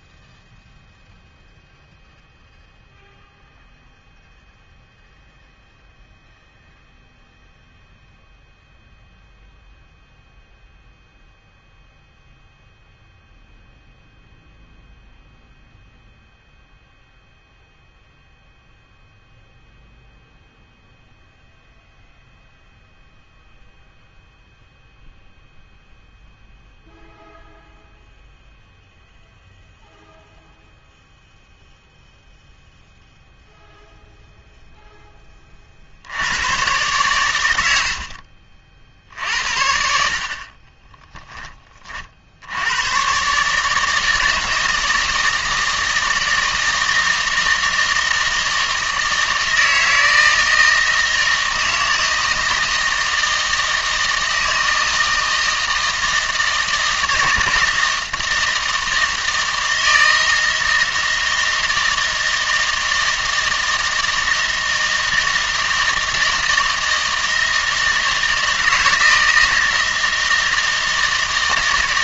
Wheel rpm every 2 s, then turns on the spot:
0, 0, 0, 0, 0, 0, 0, 0, 0, 0, 0, 0, 0, 0, 0, 0, 0, 0, 120, 50, 30, 100, 160, 160, 160, 160, 160, 160, 160, 160, 160, 160, 160, 160, 160, 160.
none